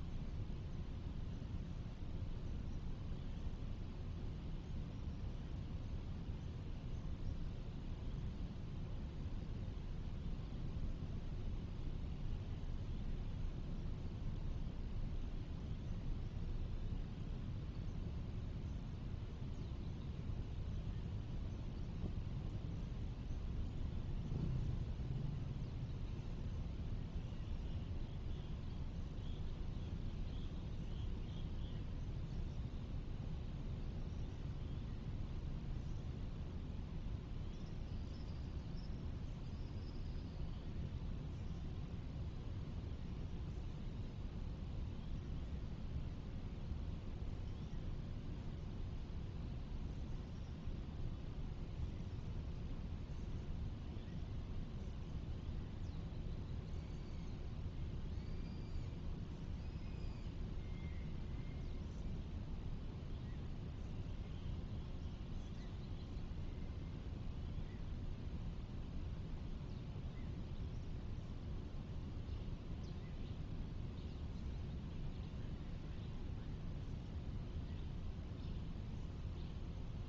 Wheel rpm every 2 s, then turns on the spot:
0, 0, 0, 0, 0, 0, 0, 0, 0, 0, 0, 0, 0, 0, 0, 0, 0, 0, 0, 0, 0, 0, 0, 0, 0, 0, 0, 0, 0, 0, 0, 0, 0, 0, 0, 0, 0, 0, 0, 0.
none